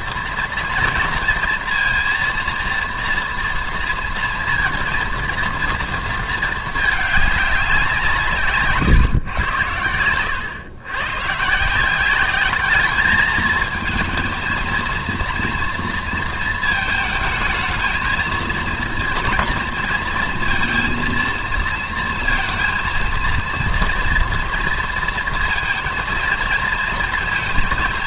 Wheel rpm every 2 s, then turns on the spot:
230, 240, 230, 210, 140, 110, 210, 230, 220, 230, 230, 230, 230, 220.
none